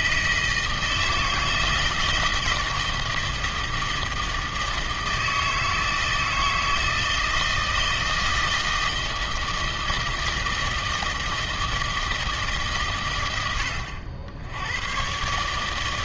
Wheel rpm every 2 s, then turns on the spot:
160, 160, 160, 160, 160, 160, 130, 100.
none